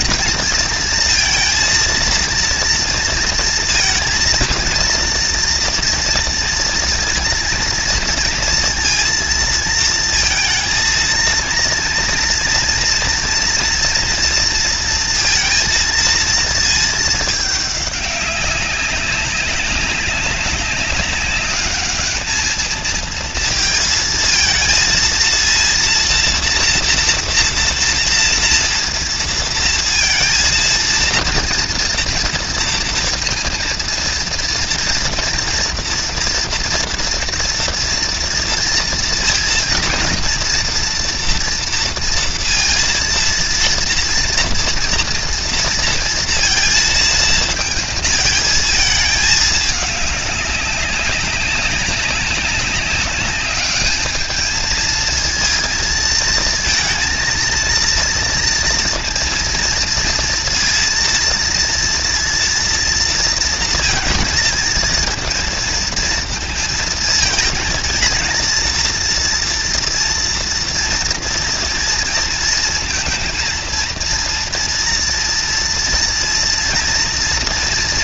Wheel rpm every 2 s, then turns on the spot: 230, 230, 230, 230, 230, 230, 230, 230, 220, 190, 190, 230, 230, 230, 230, 230, 230, 230, 240, 230, 240, 230, 230, 230, 220, 200, 200, 220, 230, 230, 230, 230, 230, 220, 230, 240, 230, 230, 240.
none